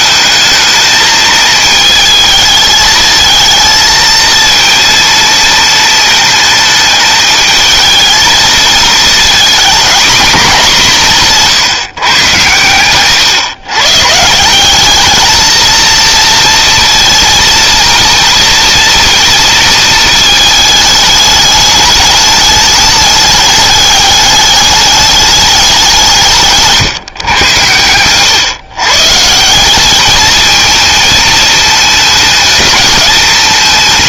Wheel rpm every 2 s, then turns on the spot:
220, 220, 230, 220, 220, 170, 120, 220, 230, 230, 210, 210, 210, 130, 140, 220, 210.
none